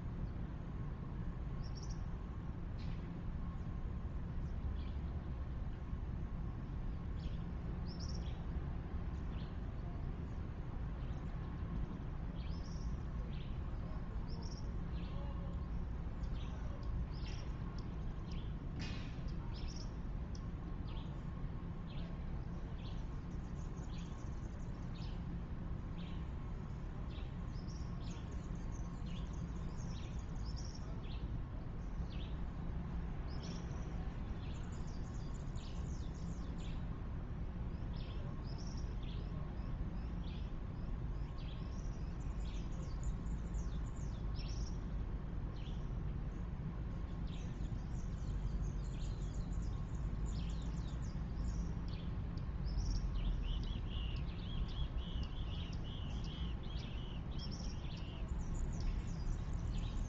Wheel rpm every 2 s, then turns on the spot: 0, 0, 0, 0, 0, 0, 0, 0, 0, 0, 0, 0, 0, 0, 0, 0, 0, 0, 0, 0, 0, 0, 0, 0, 0, 0, 0, 0, 0, 0.
none